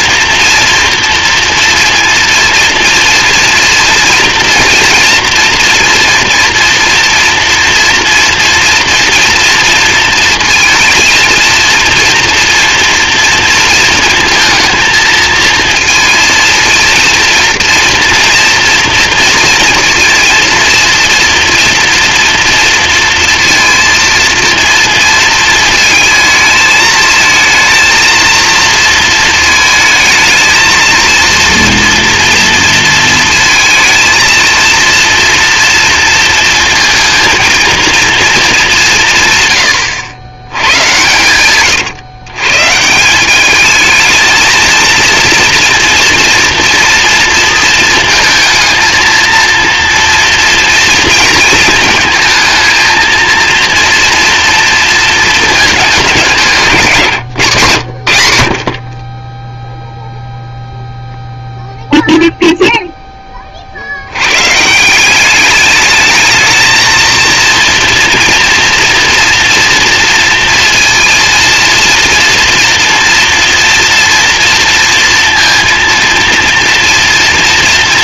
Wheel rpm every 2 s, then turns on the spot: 240, 230, 240, 240, 230, 230, 240, 230, 230, 230, 230, 230, 230, 220, 230, 230, 230, 230, 230, 180, 120, 150, 230, 230, 230, 230, 220, 230, 170, 60, 0, 0, 150, 230, 230, 230, 230, 230, 230.
none